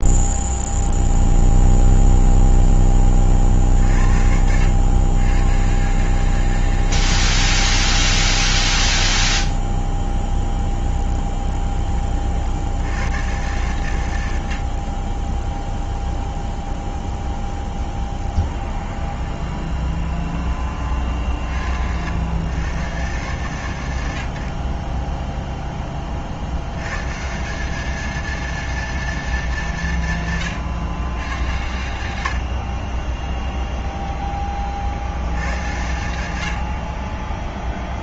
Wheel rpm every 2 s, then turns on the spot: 0, 20, 90, 130, 10, 0, 90, 30, 0, 0, 30, 110, 10, 130, 230, 120, 30, 60, 40.
32-34